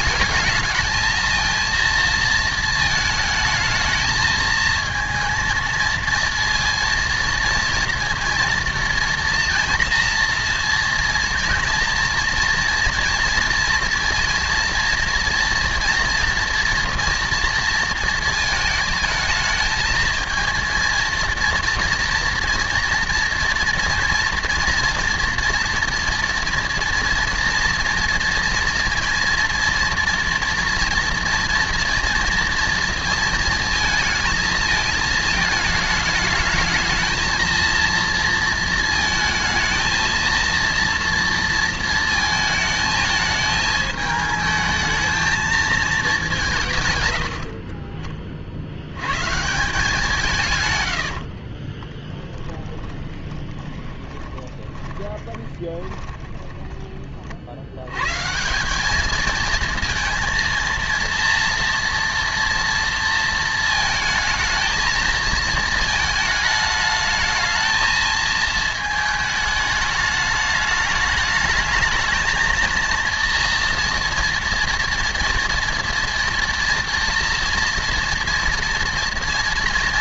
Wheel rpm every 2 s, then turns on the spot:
220, 220, 230, 230, 230, 230, 230, 230, 240, 220, 230, 230, 230, 230, 240, 230, 230, 220, 220, 230, 230, 220, 220, 140, 70, 130, 10, 20, 20, 200, 230, 230, 220, 220, 220, 210, 230, 230, 230, 230.
52-56